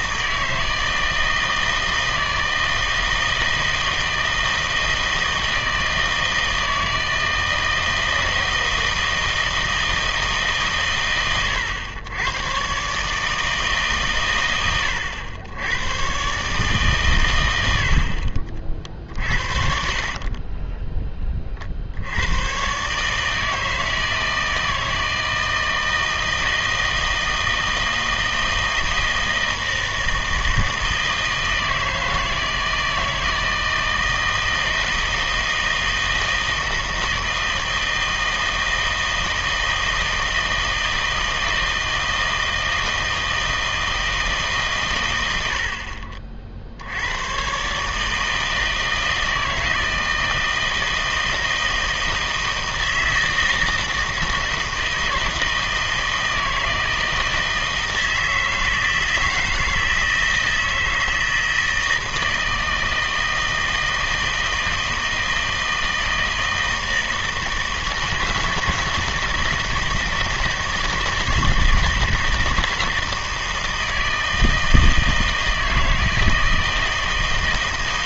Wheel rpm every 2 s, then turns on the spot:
160, 160, 160, 160, 160, 140, 120, 110, 130, 40, 30, 130, 160, 160, 160, 160, 160, 160, 160, 160, 160, 160, 140, 70, 160, 160, 160, 160, 160, 160, 160, 160, 160, 160, 160, 160, 160, 160, 160.
none